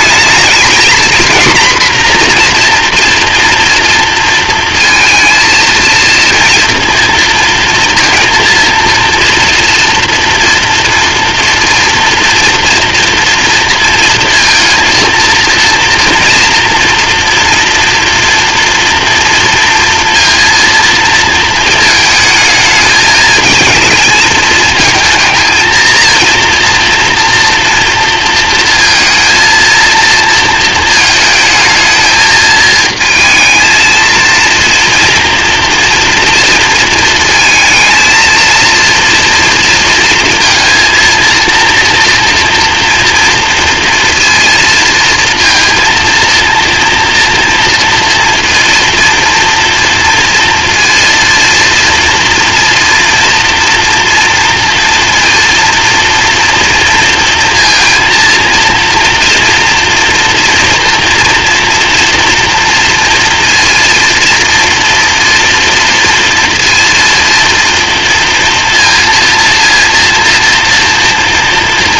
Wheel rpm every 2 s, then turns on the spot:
230, 240, 230, 230, 230, 230, 230, 230, 240, 240, 230, 220, 220, 230, 230, 220, 220, 230, 230, 230, 230, 230, 230, 240, 230, 230, 240, 230, 230, 230, 230, 230, 230, 230, 230, 240.
none